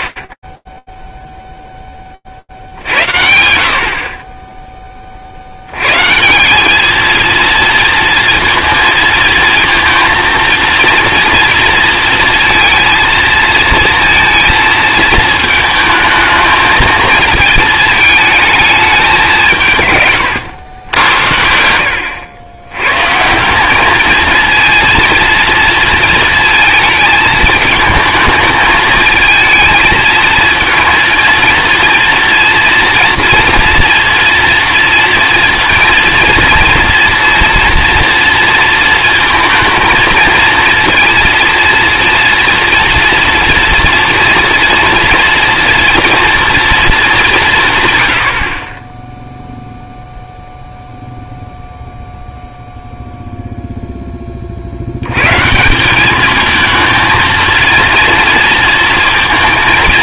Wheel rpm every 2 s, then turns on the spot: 0, 70, 80, 230, 230, 230, 230, 220, 220, 160, 80, 190, 230, 220, 220, 230, 230, 230, 230, 220, 230, 230, 230, 160, 0, 0, 0, 140, 230, 230.
none